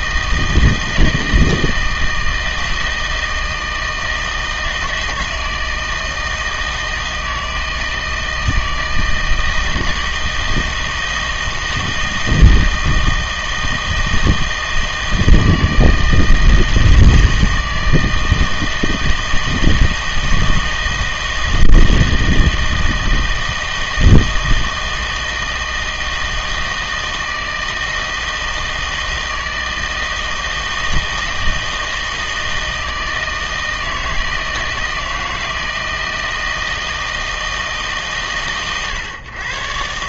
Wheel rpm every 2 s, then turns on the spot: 160, 160, 160, 160, 160, 160, 160, 160, 160, 160, 160, 160, 160, 160, 160, 160, 160, 160, 160, 120.
none